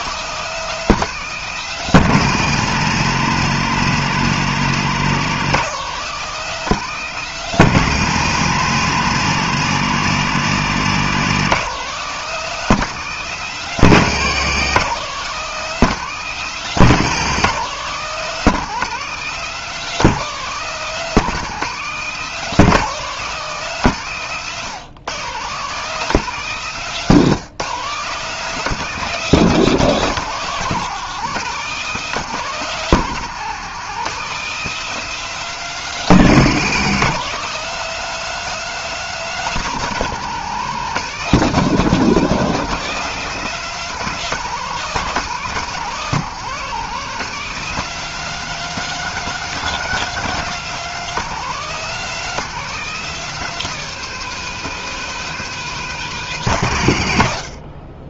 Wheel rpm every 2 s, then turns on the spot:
200, 190, 180, 190, 180, 190, 190, 180, 180, 200, 190, 200, 150, 180, 190, 180, 190, 200, 180, 210, 180, 190, 180, 180, 210, 210, 200, 210, 150.
none